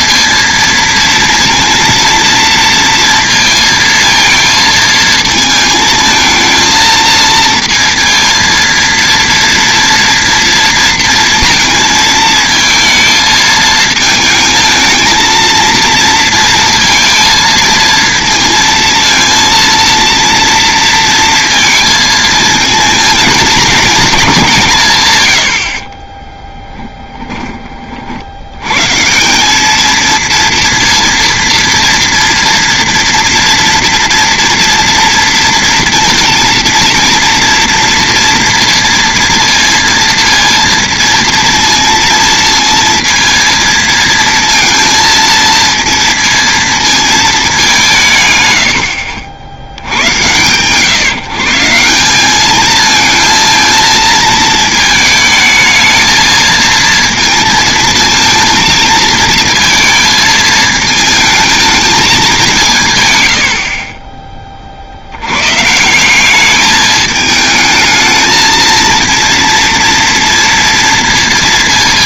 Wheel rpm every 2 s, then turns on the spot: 230, 230, 220, 220, 230, 230, 220, 220, 230, 230, 230, 230, 170, 10, 110, 230, 230, 230, 230, 230, 230, 230, 230, 230, 100, 130, 210, 220, 230, 220, 220, 170, 30, 210, 220, 230.
26-28